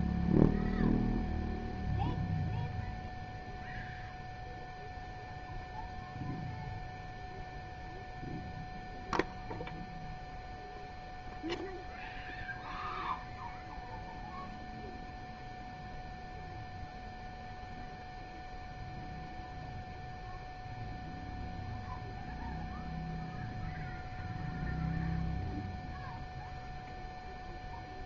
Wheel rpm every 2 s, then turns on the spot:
0, 0, 0, 0, 0, 0, 0, 0, 0, 0, 0, 0, 0, 0.
none